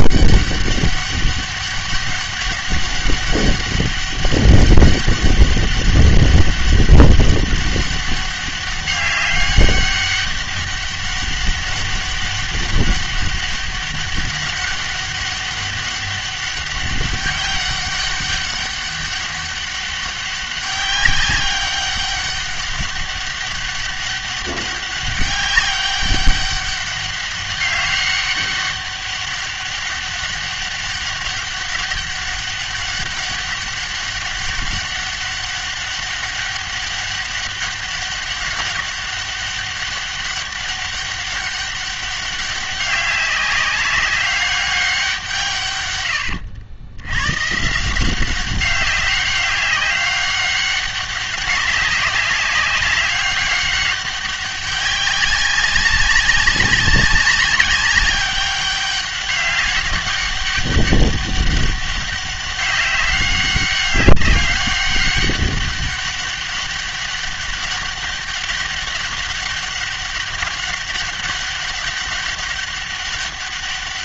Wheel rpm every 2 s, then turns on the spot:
200, 200, 200, 200, 200, 200, 200, 200, 200, 200, 200, 200, 200, 200, 200, 200, 200, 200, 200, 200, 200, 200, 200, 90, 200, 200, 200, 200, 200, 200, 200, 190, 200, 200, 200, 200, 200.
none